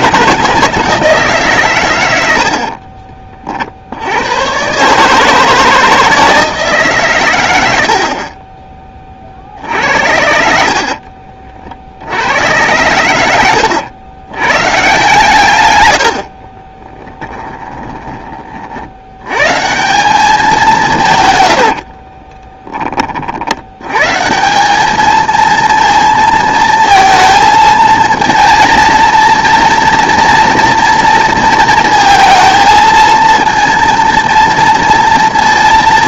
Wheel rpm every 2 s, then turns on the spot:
160, 30, 140, 150, 30, 60, 100, 140, 30, 70, 170, 30, 210, 230, 230, 230, 230, 230.
2-4 10-12 16-18